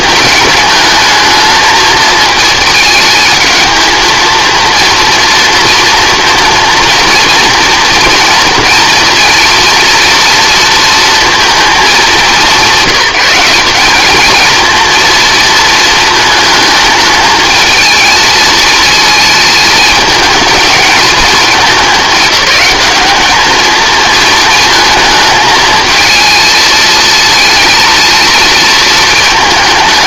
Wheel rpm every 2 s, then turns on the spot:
210, 220, 230, 230, 230, 230, 190, 230, 220, 230, 220, 210, 220, 230, 230.
none